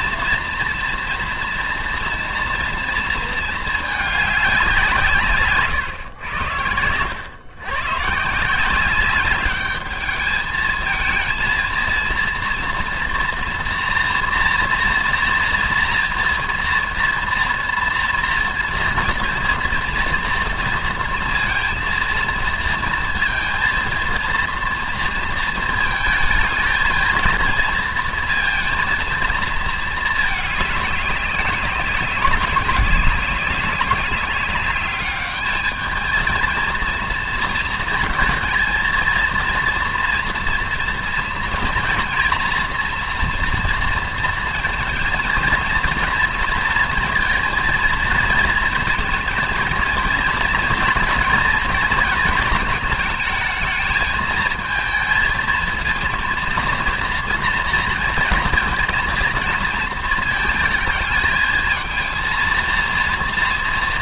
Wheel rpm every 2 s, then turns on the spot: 240, 230, 160, 100, 190, 220, 230, 230, 230, 230, 230, 230, 230, 230, 230, 200, 200, 210, 230, 230, 240, 240, 230, 230, 220, 230, 220, 220, 230, 220, 220, 240.
none